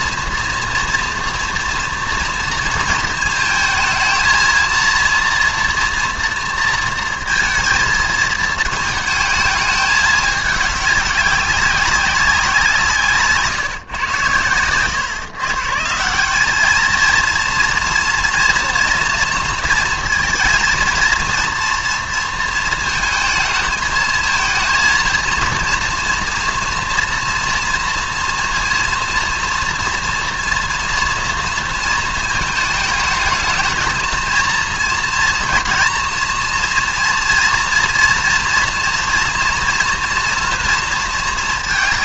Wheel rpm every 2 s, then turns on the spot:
230, 230, 230, 230, 220, 210, 180, 110, 210, 230, 230, 230, 230, 230, 230, 240, 220, 230, 230, 230, 230.
none